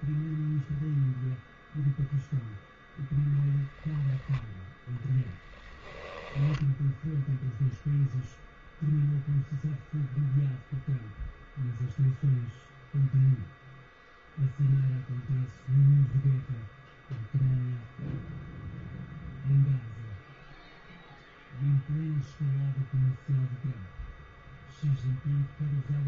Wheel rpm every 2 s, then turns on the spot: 0, 0, 0, 10, 0, 0, 0, 0, 0, 0, 0, 0, 0.
6-8